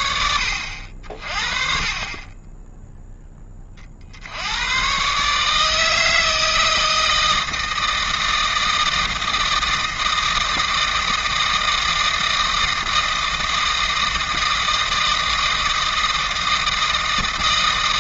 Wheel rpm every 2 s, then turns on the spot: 60, 10, 140, 160, 160, 160, 160, 160, 160.
none